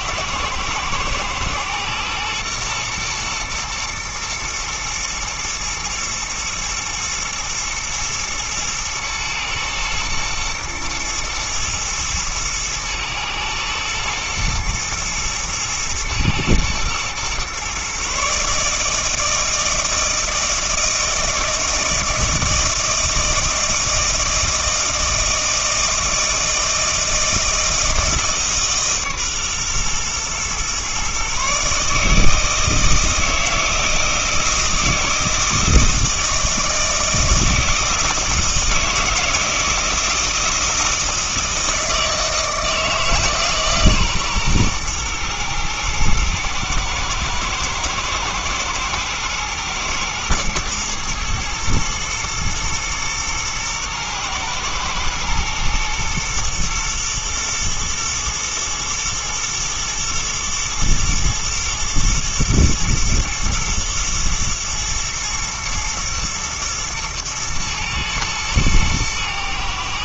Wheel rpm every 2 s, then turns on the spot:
110, 110, 110, 120, 120, 110, 120, 120, 110, 150, 160, 160, 160, 160, 150, 120, 160, 160, 160, 160, 160, 160, 130, 110, 110, 120, 120, 110, 120, 110, 110, 110, 110, 110, 110.
none